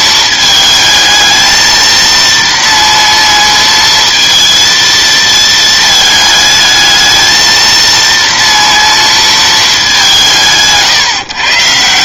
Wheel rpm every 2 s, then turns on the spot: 220, 230, 230, 220, 230, 140.
none